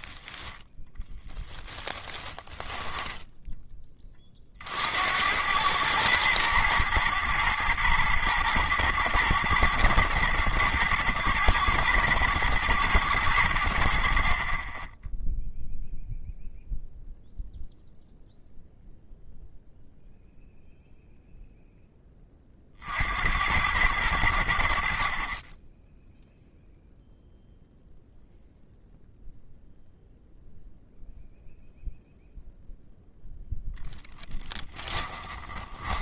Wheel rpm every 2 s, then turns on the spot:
0, 10, 60, 120, 110, 110, 120, 20, 0, 0, 0, 40, 70, 0, 0, 0, 0, 10.
2-4 34-36